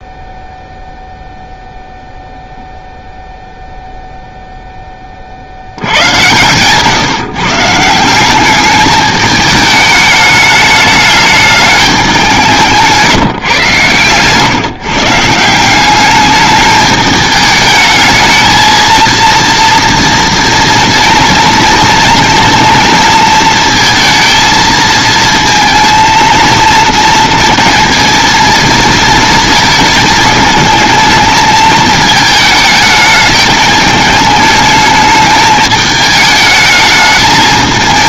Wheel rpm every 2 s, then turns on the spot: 0, 0, 0, 120, 200, 210, 170, 140, 210, 230, 230, 230, 230, 220, 220, 220, 220, 210, 210.
none